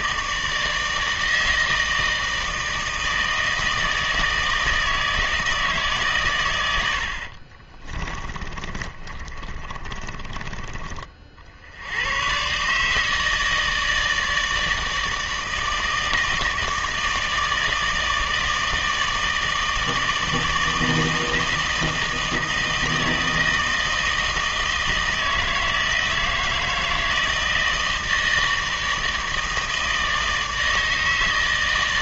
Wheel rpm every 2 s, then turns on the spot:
160, 160, 160, 80, 30, 40, 140, 160, 160, 160, 160, 160, 160, 160, 160, 160.
8-10